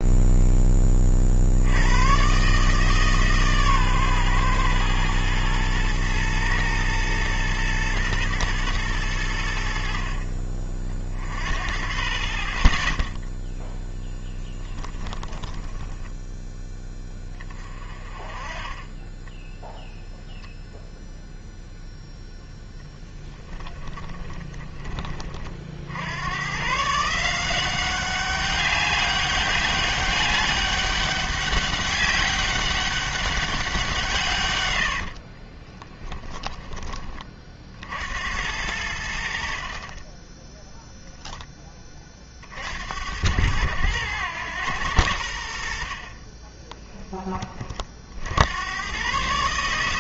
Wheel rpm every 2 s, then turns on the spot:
20, 150, 120, 110, 110, 40, 30, 10, 10, 20, 0, 10, 20, 140, 200, 200, 200, 90, 30, 90, 0, 70, 100, 10, 100.
14-16 34-36 46-48